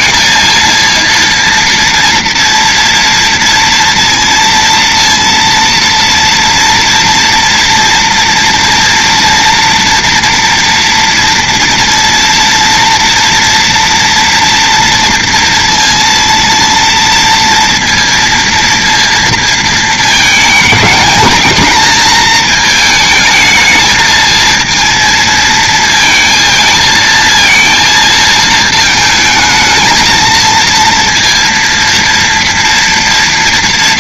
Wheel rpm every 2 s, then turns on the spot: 230, 230, 230, 230, 230, 230, 230, 230, 230, 230, 220, 220, 230, 230, 220, 230, 230.
none